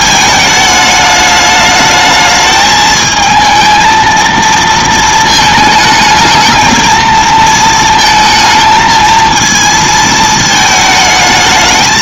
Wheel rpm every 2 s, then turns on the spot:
220, 220, 230, 220, 220, 220.
none